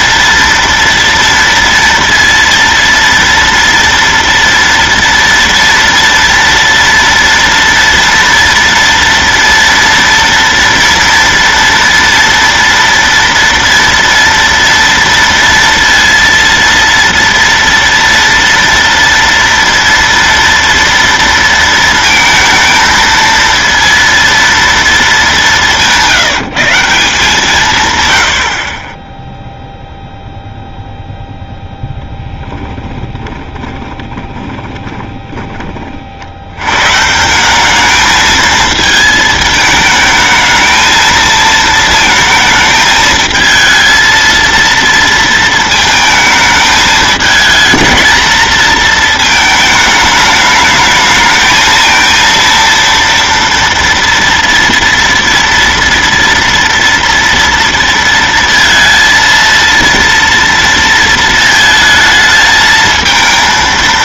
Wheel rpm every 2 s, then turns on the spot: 230, 230, 230, 230, 230, 230, 230, 230, 230, 230, 230, 220, 230, 170, 50, 0, 20, 20, 100, 220, 220, 220, 230, 220, 230, 210, 230, 230, 230, 230, 230, 220.
32-36